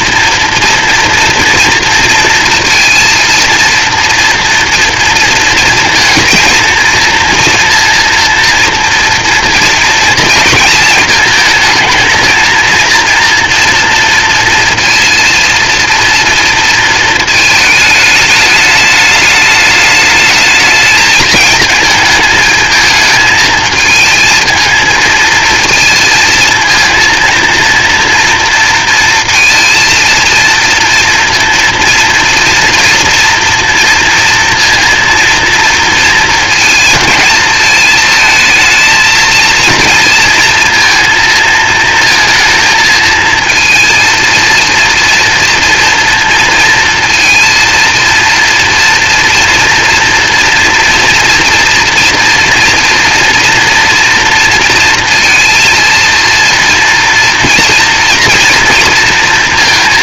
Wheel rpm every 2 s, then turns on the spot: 230, 230, 230, 230, 230, 220, 230, 230, 230, 210, 210, 220, 230, 220, 230, 230, 230, 230, 230, 220, 230, 230, 230, 230, 230, 230, 230, 230, 230, 230.
none